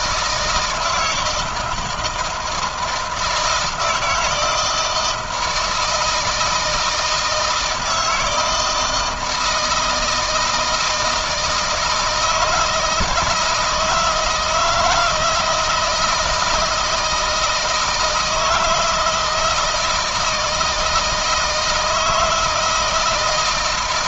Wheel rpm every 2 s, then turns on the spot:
160, 160, 160, 160, 160, 160, 160, 160, 160, 160, 160, 160.
none